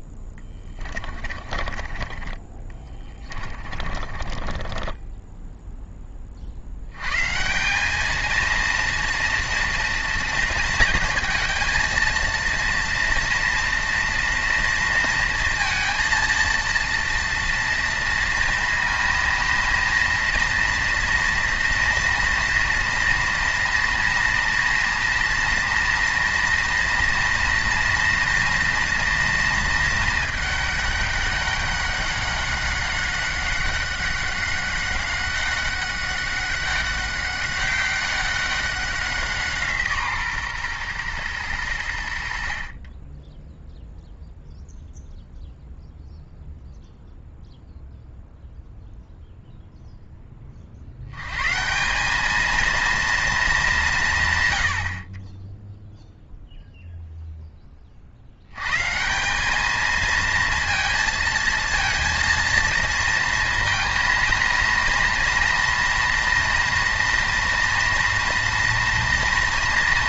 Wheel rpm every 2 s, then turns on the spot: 10, 20, 20, 80, 230, 230, 230, 230, 230, 230, 230, 230, 230, 230, 230, 200, 200, 190, 200, 190, 130, 40, 0, 0, 0, 40, 230, 80, 0, 130, 230, 230, 230, 230, 230.
0-6